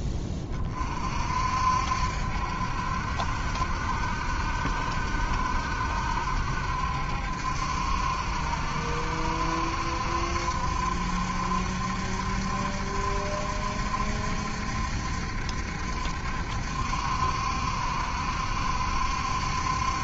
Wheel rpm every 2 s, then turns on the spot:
30, 70, 70, 70, 70, 70, 70, 70, 70, 70.
none